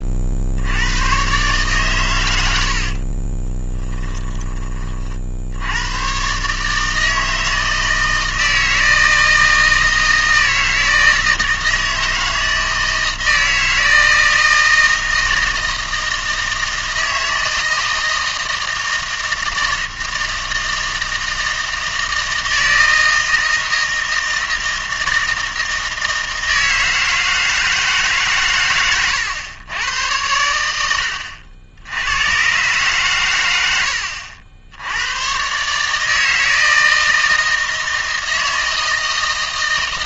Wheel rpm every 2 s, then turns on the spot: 80, 80, 20, 150, 160, 160, 160, 160, 160, 160, 160, 160, 160, 160, 130, 90, 120, 70, 160, 160.
2-4